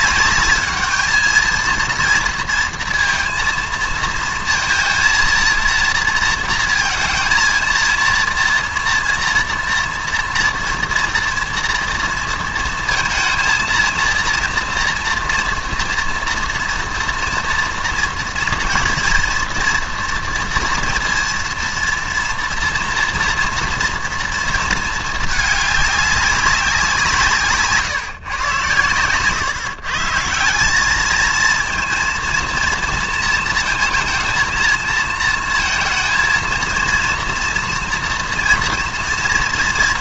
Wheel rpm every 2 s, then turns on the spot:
210, 230, 230, 220, 230, 230, 230, 230, 230, 230, 230, 230, 230, 190, 130, 190, 230, 220, 230, 230.
none